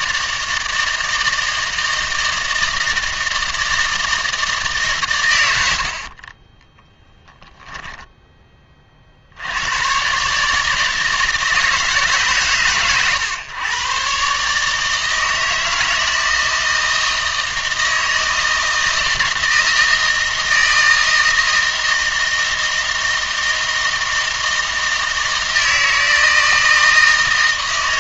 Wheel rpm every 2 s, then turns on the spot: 160, 160, 160, 20, 30, 150, 130, 150, 160, 160, 160, 160, 160, 160.
none